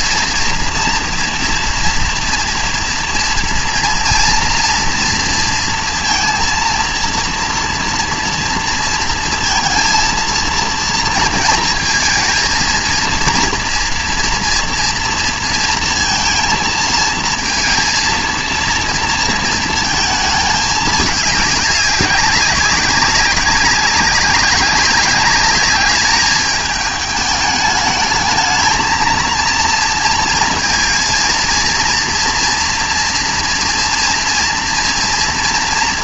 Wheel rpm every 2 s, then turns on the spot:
230, 230, 230, 230, 230, 230, 230, 230, 230, 230, 210, 200, 200, 210, 230, 230, 230, 230.
none